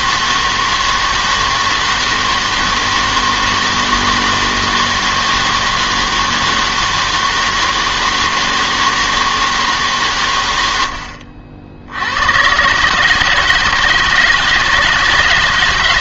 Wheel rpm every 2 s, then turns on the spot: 160, 160, 160, 160, 160, 90, 130, 160.
none